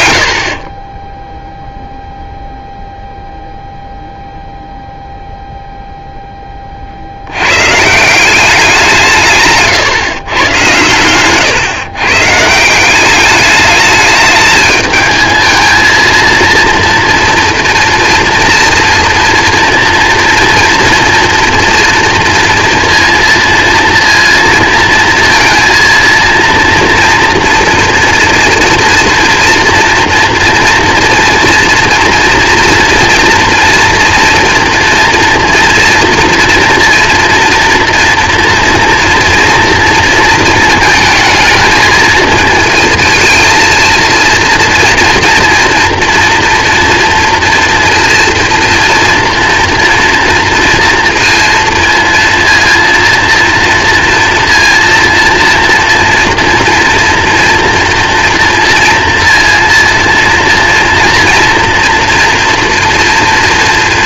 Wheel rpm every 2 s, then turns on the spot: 40, 0, 0, 40, 190, 110, 170, 220, 230, 230, 230, 230, 230, 230, 230, 240, 240, 240, 240, 230, 220, 220, 230, 240, 230, 230, 230, 230, 240, 230, 230, 230.
0-2